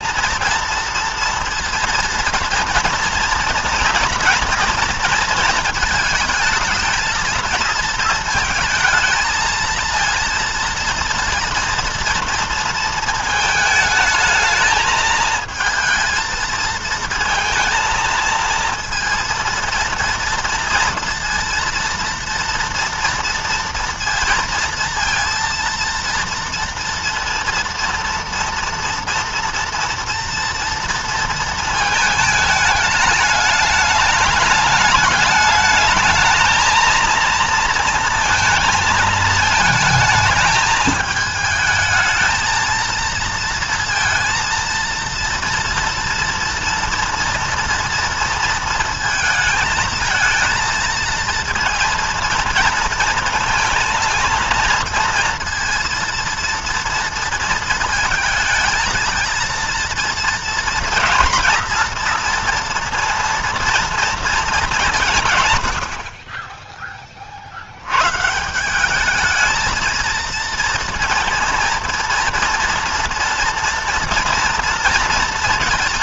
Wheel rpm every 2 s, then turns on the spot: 230, 230, 230, 220, 220, 230, 230, 220, 220, 230, 230, 230, 230, 230, 230, 230, 210, 210, 220, 230, 220, 220, 230, 230, 230, 230, 230, 230, 230, 220, 230, 230, 210, 20, 170, 230, 230, 230.
none